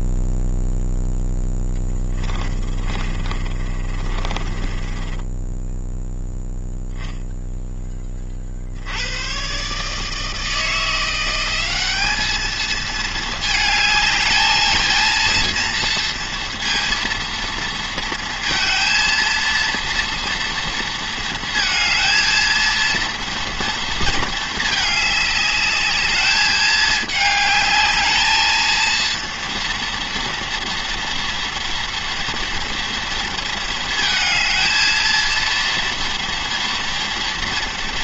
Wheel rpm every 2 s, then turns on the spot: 0, 20, 20, 0, 70, 170, 220, 220, 230, 230, 230, 230, 210, 220, 220, 230, 230, 230, 230.
2-6